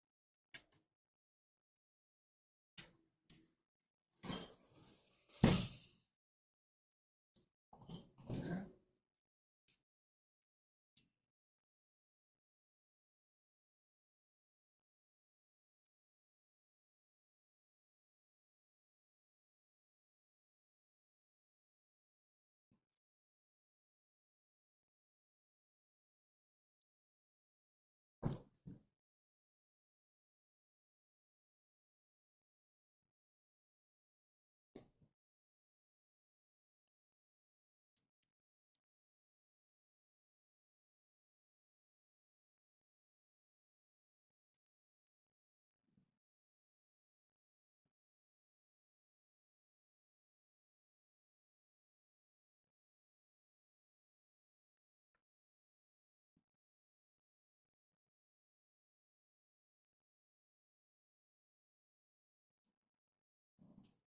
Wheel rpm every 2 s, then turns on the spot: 0, 0, 0, 0, 0, 0, 0, 0, 0, 0, 0, 0, 0, 0, 0, 0, 0, 0, 0, 0, 0, 0, 0, 0, 0, 0, 0, 0, 0, 0, 0, 0.
none